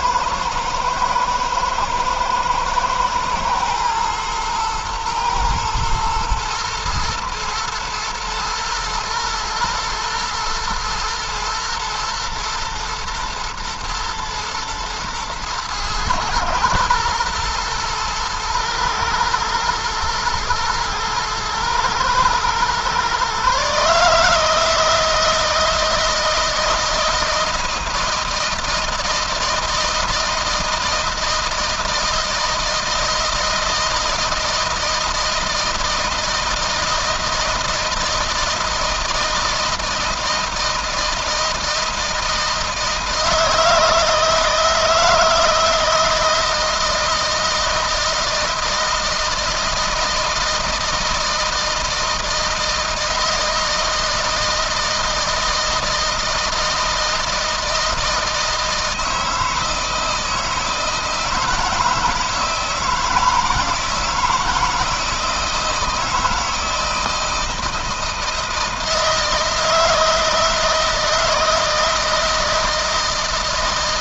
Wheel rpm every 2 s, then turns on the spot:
110, 110, 110, 120, 110, 110, 110, 110, 120, 120, 120, 130, 160, 160, 160, 160, 160, 160, 160, 160, 160, 160, 160, 160, 160, 160, 160, 160, 160, 160, 160, 160, 160, 160, 160, 160, 170.
none